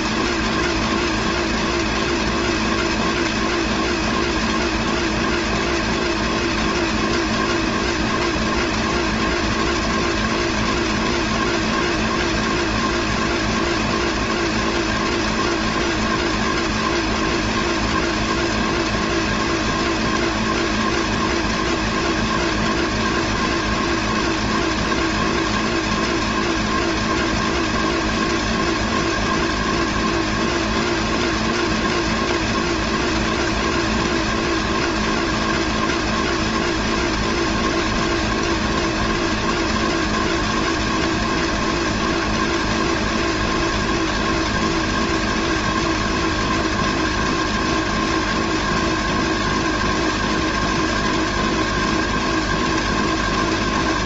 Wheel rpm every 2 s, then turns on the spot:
240, 240, 240, 240, 240, 240, 240, 240, 240, 240, 240, 240, 230, 240, 230, 240, 240, 240, 240, 240, 230, 240, 230, 230, 230, 230, 230.
none